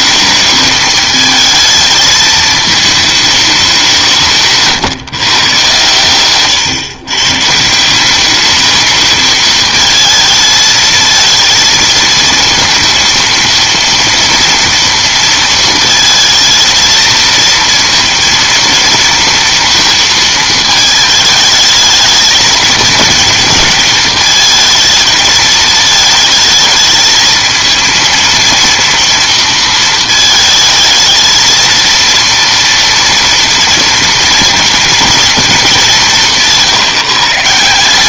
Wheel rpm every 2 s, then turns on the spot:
220, 220, 150, 120, 220, 220, 230, 230, 220, 230, 220, 220, 220, 220, 230, 220, 230, 230, 170.
none